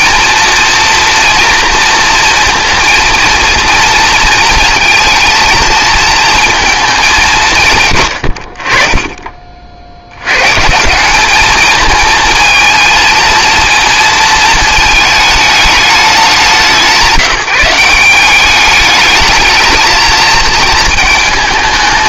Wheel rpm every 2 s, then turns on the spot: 230, 230, 230, 220, 60, 140, 220, 220, 190, 200, 230.
none